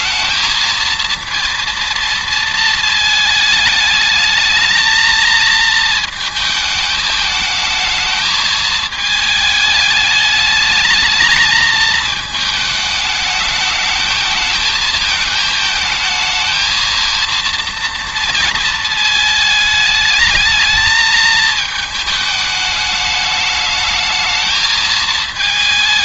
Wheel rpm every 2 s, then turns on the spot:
230, 230, 220, 220, 220, 220, 220, 220, 230, 220, 220, 210, 220.
none